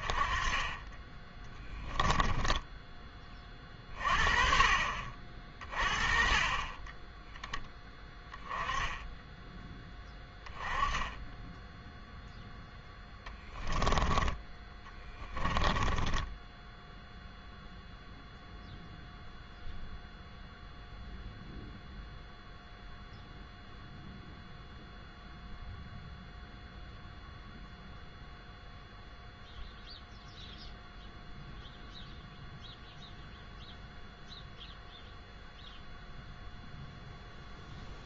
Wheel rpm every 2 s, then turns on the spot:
20, 10, 40, 30, 10, 10, 0, 10, 0, 0, 0, 0, 0, 0, 0, 0, 0, 0, 0.
14-16